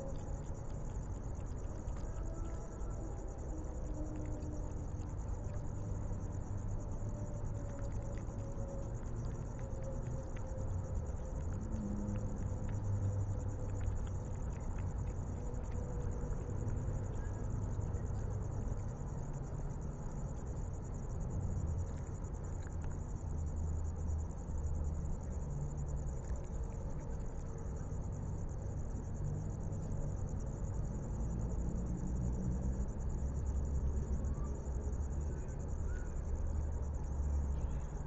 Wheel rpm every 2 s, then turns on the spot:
0, 0, 0, 0, 0, 0, 0, 0, 0, 0, 0, 0, 0, 0, 0, 0, 0, 0, 0.
none